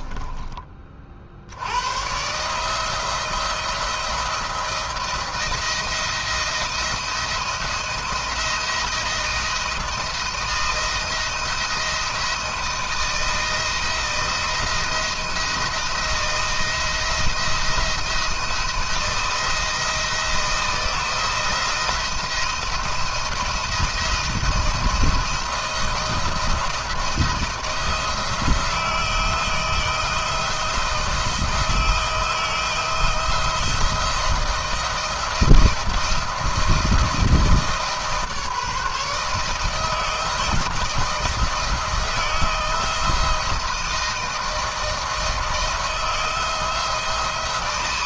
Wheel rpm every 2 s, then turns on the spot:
30, 150, 170, 170, 170, 160, 170, 170, 170, 170, 170, 170, 170, 170, 160, 160, 160, 160, 160, 160, 160, 160, 160, 170.
none